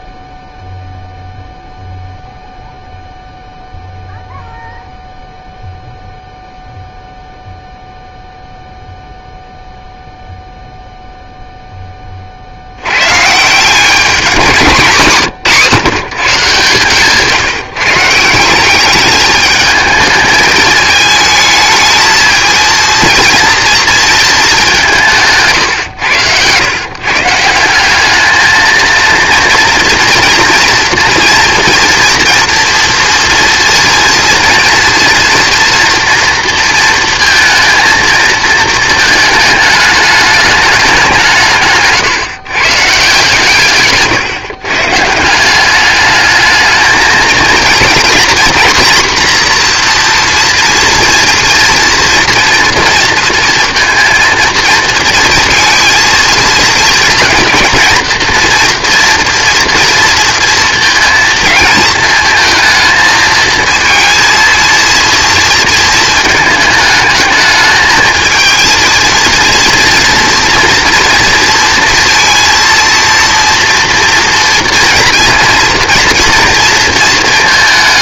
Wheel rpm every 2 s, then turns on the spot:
0, 0, 0, 0, 0, 0, 90, 180, 150, 190, 220, 220, 190, 130, 230, 230, 230, 230, 230, 220, 200, 150, 130, 220, 250, 230, 230, 230, 220, 230, 230, 220, 230, 210, 230, 230, 230, 230, 230.
16-18